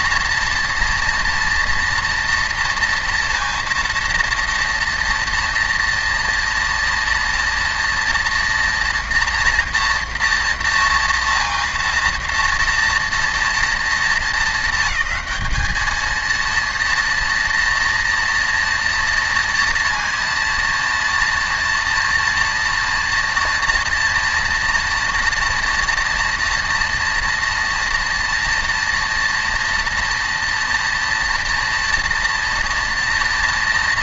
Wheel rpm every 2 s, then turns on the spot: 230, 230, 230, 230, 240, 230, 230, 210, 230, 230, 230, 240, 230, 230, 230, 230, 230.
none